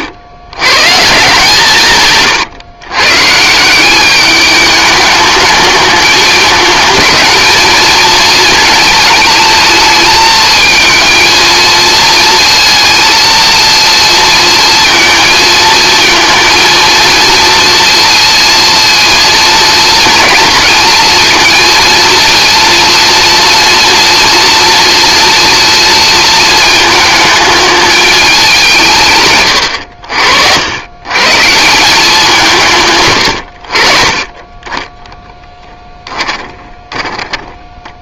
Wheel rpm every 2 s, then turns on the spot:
130, 120, 210, 220, 220, 230, 230, 230, 220, 230, 230, 230, 230, 230, 180, 80, 160, 20, 10.
36-38